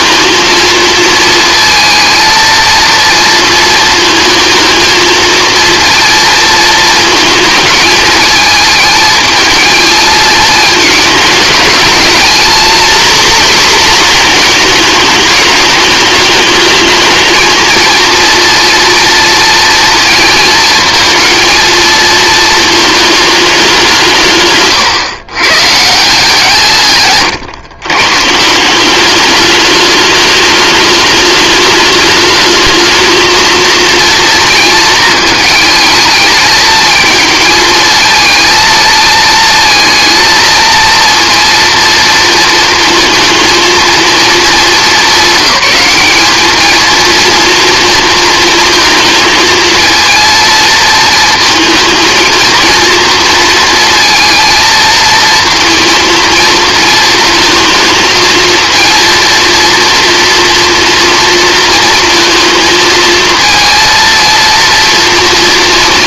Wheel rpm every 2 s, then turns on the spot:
230, 230, 220, 220, 220, 220, 250, 210, 230, 230, 230, 200, 130, 120, 210, 220, 230, 220, 220, 230, 230, 230, 210, 230, 220, 230, 230, 230, 220, 230, 230, 230, 230.
none